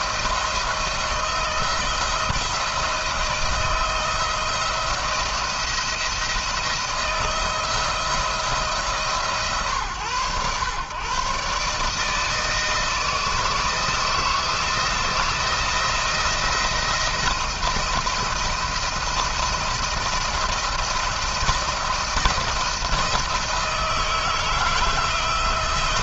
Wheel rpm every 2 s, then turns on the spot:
170, 170, 170, 170, 160, 110, 160, 160, 170, 170, 170, 160, 170.
none